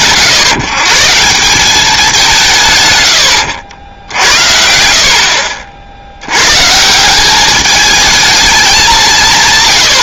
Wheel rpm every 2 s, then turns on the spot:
130, 130, 60, 150, 200.
none